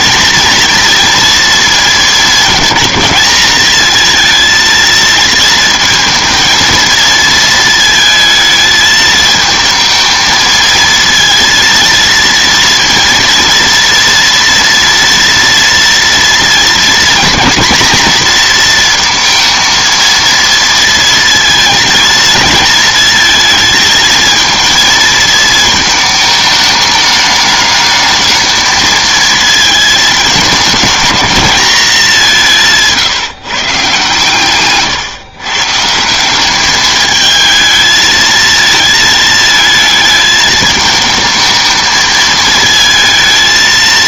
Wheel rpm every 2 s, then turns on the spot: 240, 220, 230, 230, 220, 230, 230, 240, 240, 230, 230, 230, 220, 210, 220, 210, 180, 150, 200, 220, 220, 220.
34-36